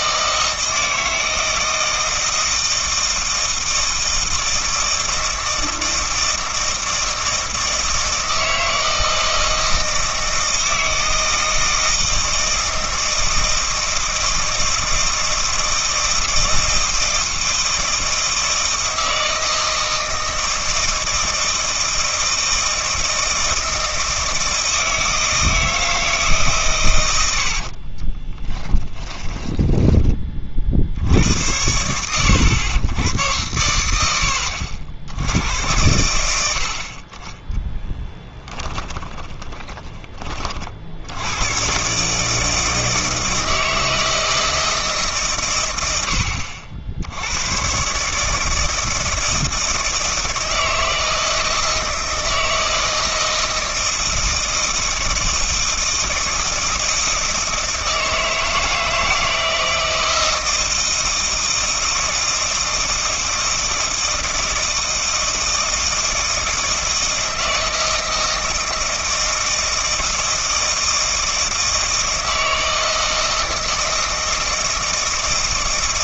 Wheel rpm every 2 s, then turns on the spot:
160, 160, 160, 160, 160, 160, 160, 160, 160, 160, 160, 160, 160, 130, 20, 50, 100, 70, 70, 20, 50, 160, 160, 70, 160, 160, 160, 160, 160, 160, 160, 160, 160, 160, 160, 160, 160, 160.
28-30 38-40